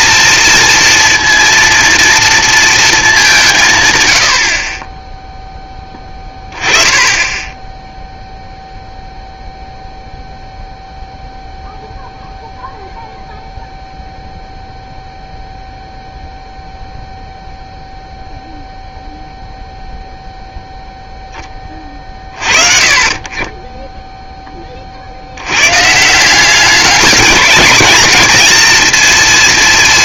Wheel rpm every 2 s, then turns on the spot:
230, 230, 40, 20, 0, 0, 0, 0, 0, 0, 0, 30, 20, 200, 230.
none